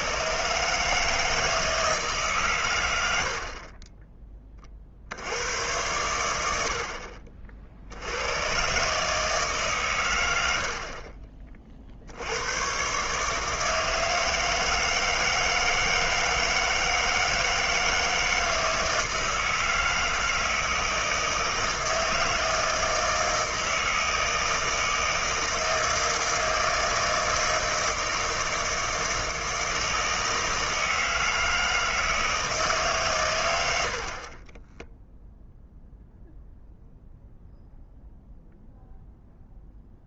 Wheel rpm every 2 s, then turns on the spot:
140, 120, 30, 70, 110, 80, 110, 160, 160, 160, 160, 160, 160, 160, 160, 160, 160, 20, 0, 0.
none